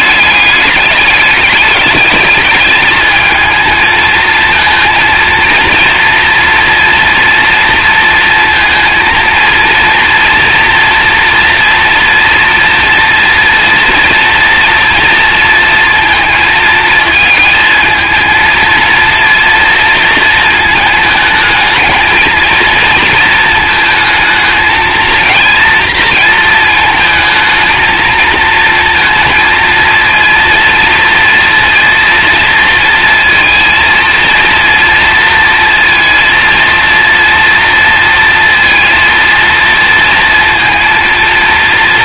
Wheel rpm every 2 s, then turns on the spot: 200, 220, 230, 240, 230, 230, 230, 230, 220, 230, 220, 230, 220, 230, 230, 230, 230, 230, 230, 230, 230.
none